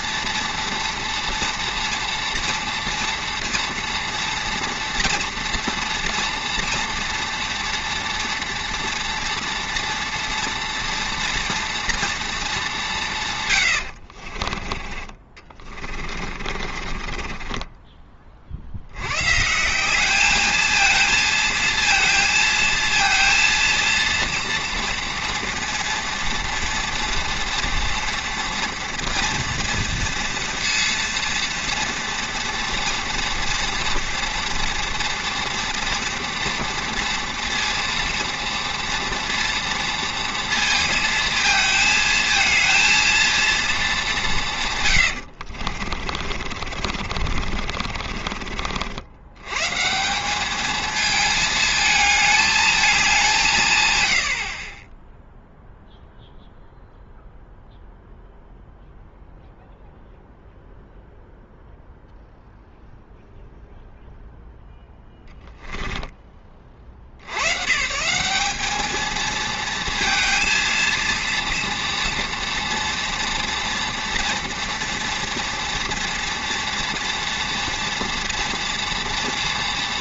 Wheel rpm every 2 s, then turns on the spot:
240, 240, 230, 230, 230, 230, 210, 40, 40, 70, 220, 230, 230, 230, 230, 230, 230, 240, 230, 230, 230, 220, 150, 60, 60, 220, 220, 30, 0, 0, 0, 0, 0, 30, 210, 230, 230, 230, 230, 230.
14-18 46-48